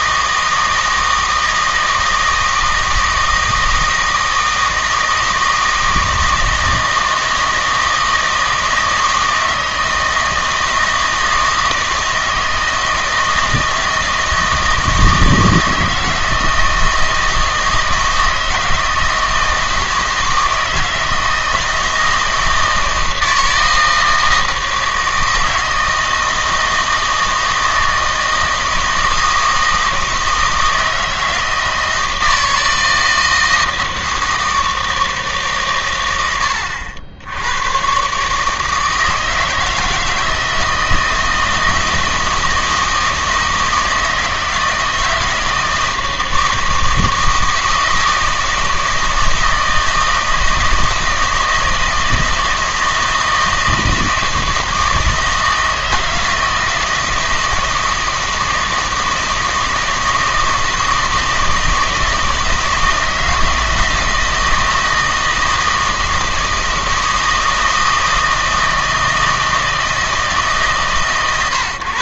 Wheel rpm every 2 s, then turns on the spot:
160, 160, 160, 160, 160, 160, 160, 160, 160, 160, 160, 160, 160, 160, 160, 160, 160, 160, 90, 150, 160, 160, 160, 160, 160, 160, 160, 160, 160, 160, 160, 160, 160, 160, 160, 150.
none